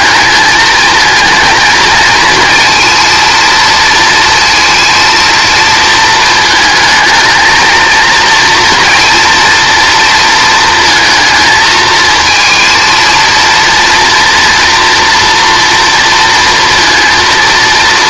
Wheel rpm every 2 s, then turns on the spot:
220, 230, 230, 220, 230, 230, 230, 230, 230.
none